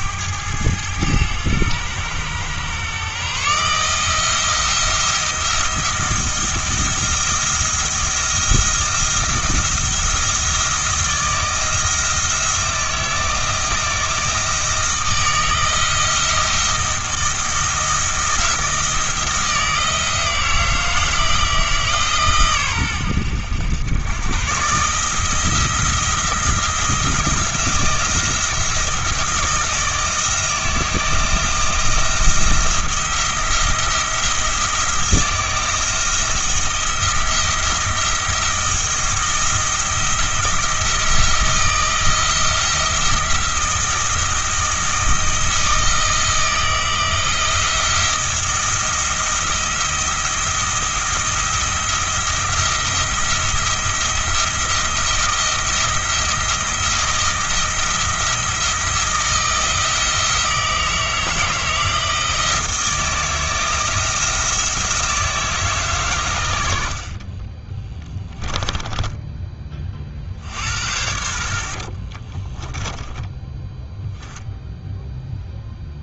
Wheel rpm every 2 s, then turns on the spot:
100, 120, 170, 170, 170, 170, 160, 160, 170, 170, 160, 120, 140, 170, 170, 160, 170, 170, 170, 170, 170, 170, 170, 170, 170, 170, 170, 170, 170, 170, 160, 160, 160, 70, 10, 70, 30, 0.
68-70 72-74